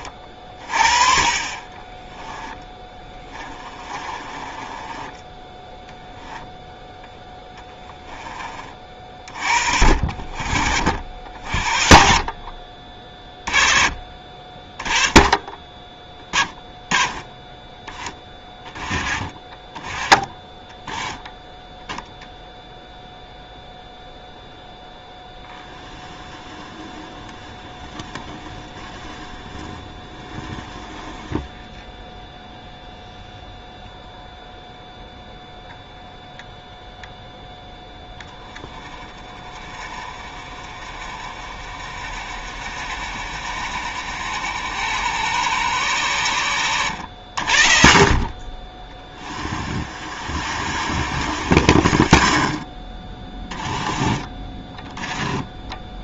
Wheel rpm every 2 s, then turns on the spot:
30, 20, 10, 0, 40, 60, 40, 20, 10, 20, 10, 0, 0, 20, 10, 10, 10, 0, 0, 20, 30, 40, 60, 70, 20, 50, 30, 20.
2-6 18-22 54-56